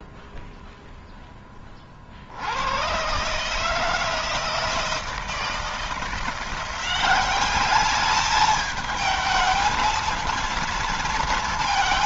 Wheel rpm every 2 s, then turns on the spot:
0, 90, 160, 180, 220, 230.
none